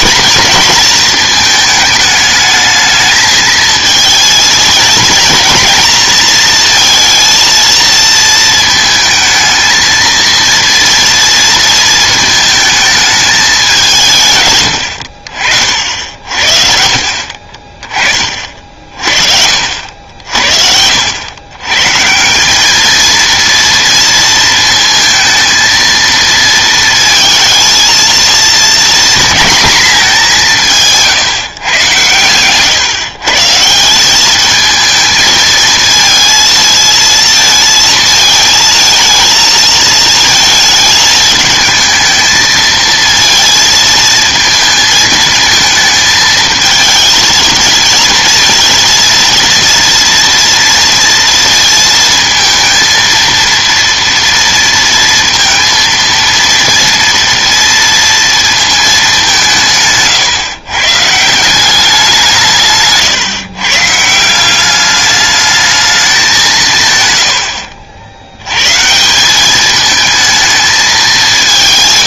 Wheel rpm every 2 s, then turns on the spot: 230, 210, 230, 230, 220, 230, 220, 110, 50, 40, 70, 200, 230, 230, 230, 180, 120, 210, 220, 220, 220, 220, 220, 220, 230, 230, 230, 230, 230, 230, 130, 150, 190, 190, 110, 220.
none